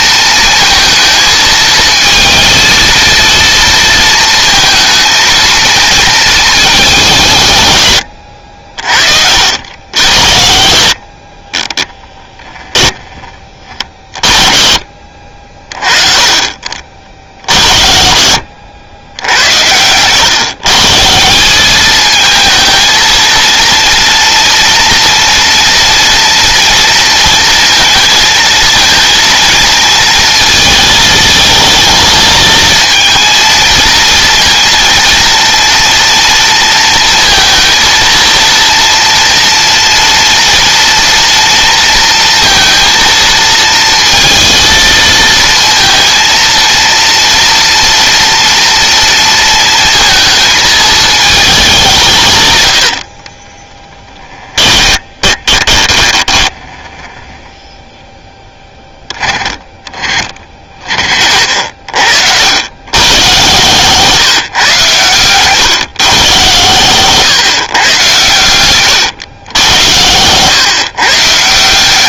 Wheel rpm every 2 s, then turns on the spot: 220, 230, 230, 190, 60, 60, 10, 50, 50, 80, 150, 230, 230, 230, 230, 220, 230, 230, 230, 230, 230, 230, 230, 230, 230, 220, 70, 20, 10, 20, 40, 120, 130, 140, 130, 130.
10-12 52-58